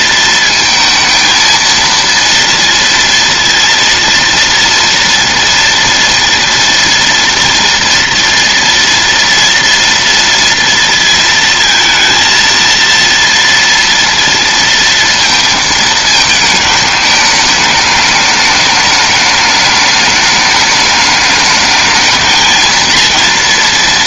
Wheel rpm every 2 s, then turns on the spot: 230, 230, 230, 230, 230, 230, 230, 230, 220, 210, 210, 230.
none